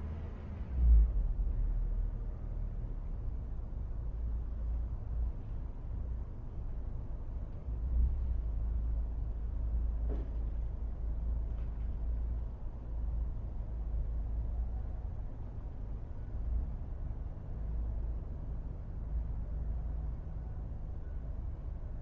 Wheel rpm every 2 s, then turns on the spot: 0, 0, 0, 0, 0, 0, 0, 0, 0, 0, 0.
none